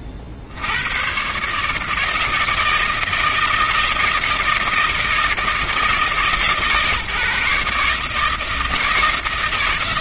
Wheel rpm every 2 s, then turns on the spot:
80, 160, 160, 150, 160.
none